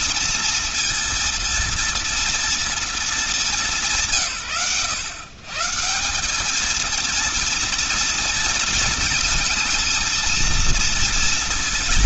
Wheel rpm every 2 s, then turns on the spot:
230, 230, 130, 220, 230, 230.
none